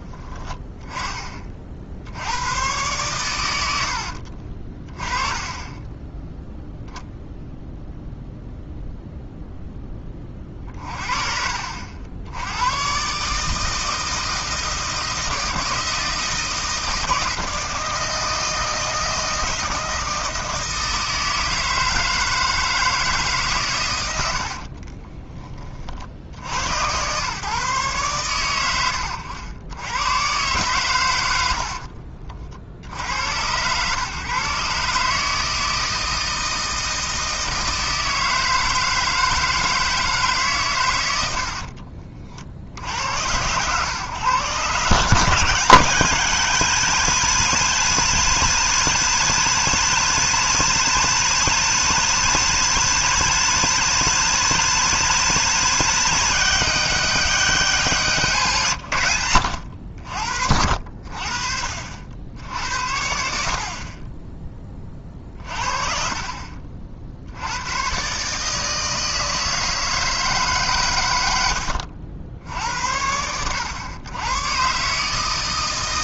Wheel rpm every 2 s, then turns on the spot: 10, 110, 30, 0, 0, 30, 110, 160, 160, 160, 160, 160, 50, 90, 100, 120, 60, 140, 160, 160, 120, 60, 140, 170, 180, 180, 180, 180, 180, 120, 60, 70, 20, 50, 160, 130, 70, 140.
4-6 24-26